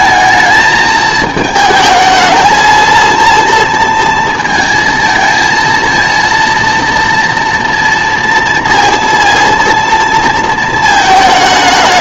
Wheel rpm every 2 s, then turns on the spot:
220, 230, 220, 230, 230, 220.
none